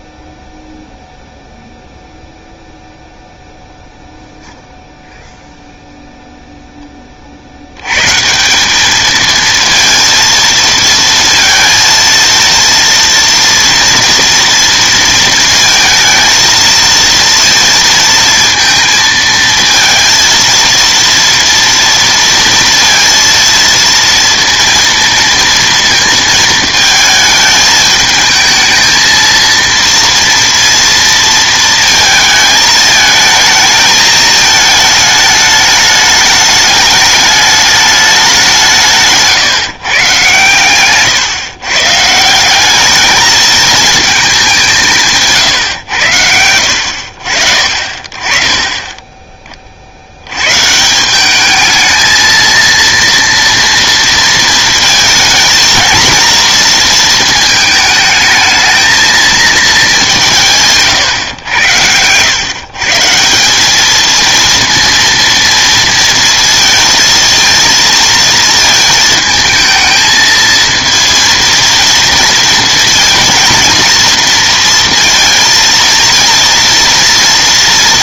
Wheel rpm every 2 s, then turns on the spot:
0, 0, 0, 10, 190, 220, 230, 230, 220, 230, 230, 230, 230, 220, 220, 230, 220, 220, 210, 180, 130, 190, 200, 80, 30, 130, 230, 220, 230, 220, 150, 130, 230, 230, 230, 220, 230, 230, 230.
none